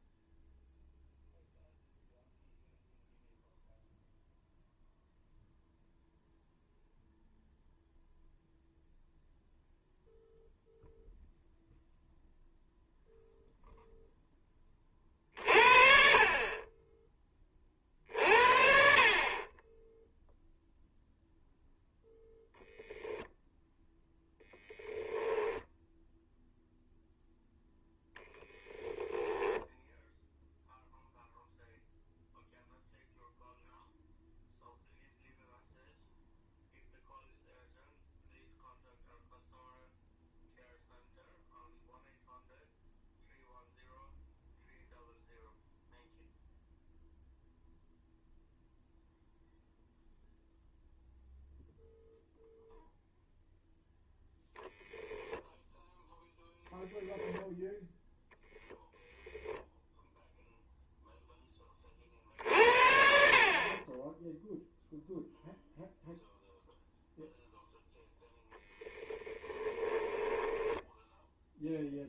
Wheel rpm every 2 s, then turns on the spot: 0, 0, 0, 0, 0, 0, 0, 30, 20, 50, 0, 0, 10, 0, 10, 0, 0, 0, 0, 0, 0, 0, 0, 0, 0, 0, 0, 0, 0, 10, 0, 60, 0, 0, 10, 10.
28-30 70-72